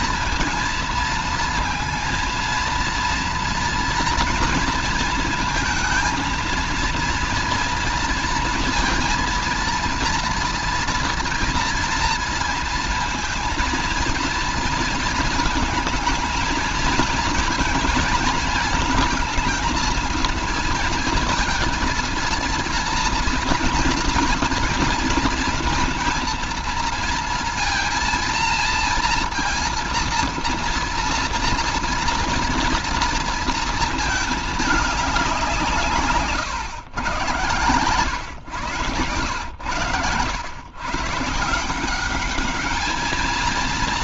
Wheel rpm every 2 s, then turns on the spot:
230, 230, 230, 230, 230, 230, 230, 230, 220, 220, 220, 230, 230, 230, 230, 230, 230, 200, 140, 120, 120, 210.
none